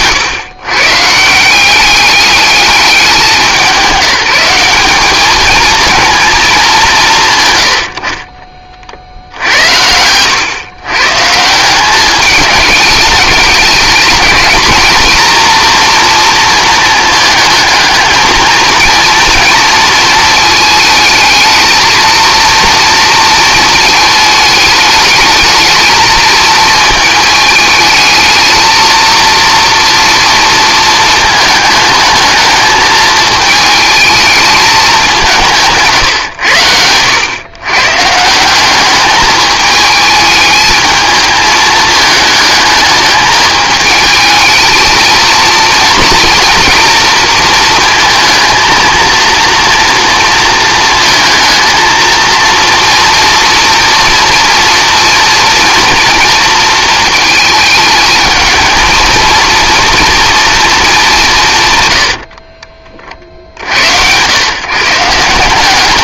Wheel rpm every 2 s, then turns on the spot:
140, 200, 210, 190, 40, 120, 210, 230, 220, 220, 220, 230, 210, 220, 230, 230, 220, 210, 100, 200, 220, 210, 220, 240, 230, 230, 240, 240, 230, 220, 230, 50, 140.
none